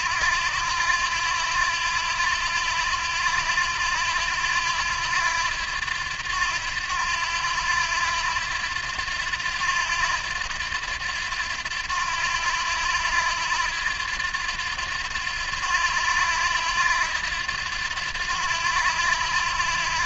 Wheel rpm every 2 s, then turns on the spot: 90, 90, 90, 90, 90, 90, 90, 90, 90, 90.
none